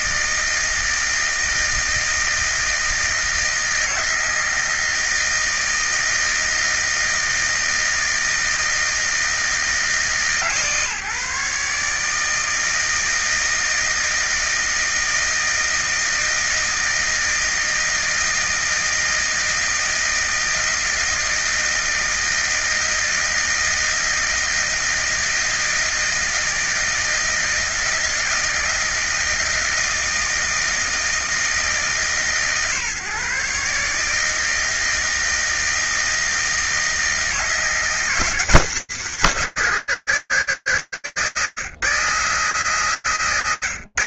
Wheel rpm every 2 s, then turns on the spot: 160, 160, 160, 160, 160, 150, 160, 160, 160, 160, 160, 160, 160, 160, 160, 160, 150, 160, 160, 200, 180, 160.
none